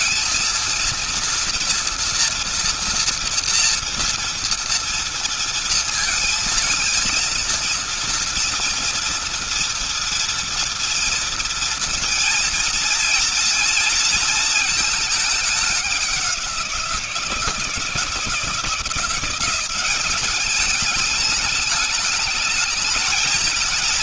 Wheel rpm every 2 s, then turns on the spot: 230, 240, 230, 230, 230, 230, 230, 220, 190, 160, 200, 210.
none